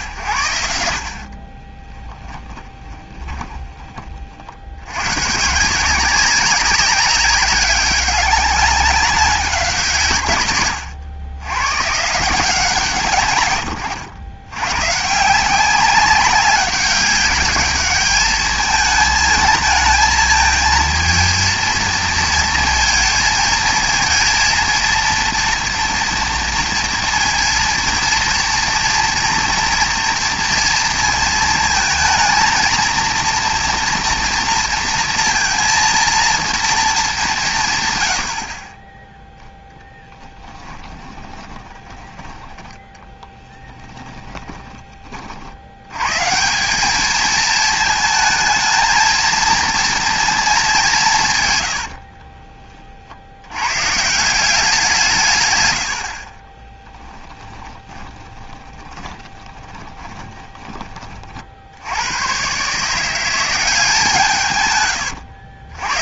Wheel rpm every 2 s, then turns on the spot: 70, 20, 80, 190, 200, 120, 160, 130, 200, 220, 220, 230, 230, 230, 230, 230, 230, 230, 230, 30, 10, 10, 20, 200, 220, 200, 30, 180, 10, 20, 20, 150, 130.
2-4 40-42 56-60